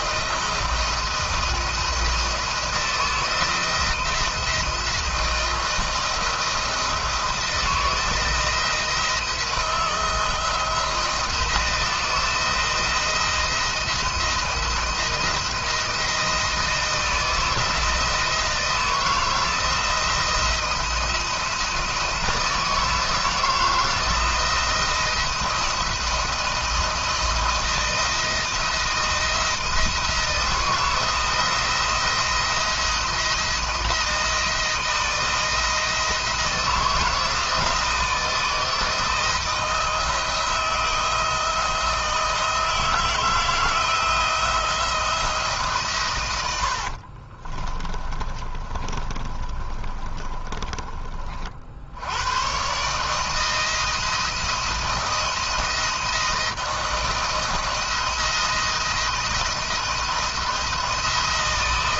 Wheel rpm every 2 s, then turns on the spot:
170, 160, 160, 170, 160, 160, 170, 170, 170, 160, 170, 160, 170, 170, 160, 160, 170, 160, 160, 160, 160, 160, 160, 100, 30, 30, 120, 170, 170, 170, 170.
46-52